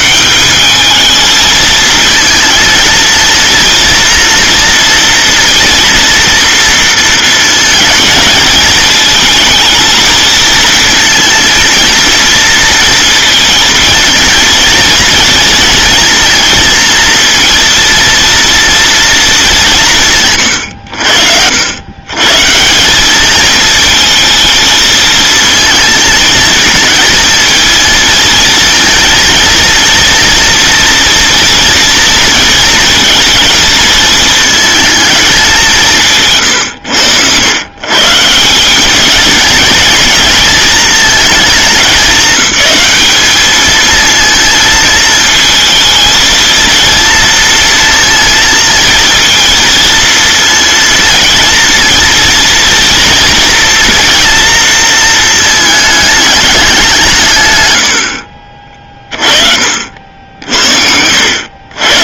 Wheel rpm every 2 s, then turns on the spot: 210, 230, 230, 230, 220, 220, 230, 230, 230, 230, 100, 170, 230, 220, 230, 230, 220, 220, 120, 190, 220, 200, 220, 230, 230, 230, 230, 230, 190, 40, 60.
none